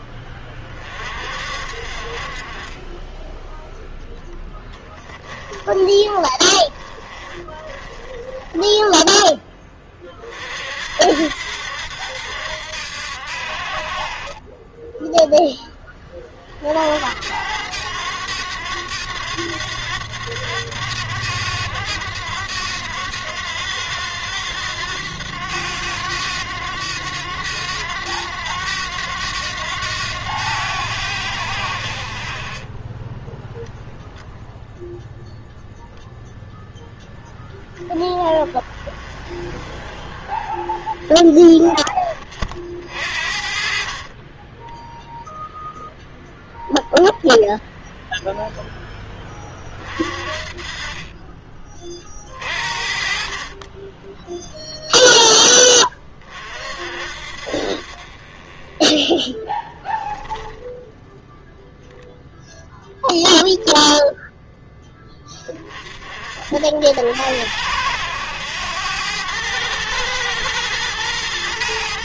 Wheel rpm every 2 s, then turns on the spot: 30, 30, 10, 20, 10, 50, 80, 20, 50, 100, 100, 90, 90, 100, 90, 90, 30, 0, 0, 20, 30, 50, 20, 0, 0, 30, 40, 10, 40, 30, 10, 0, 10, 60, 100, 110.
4-10 44-46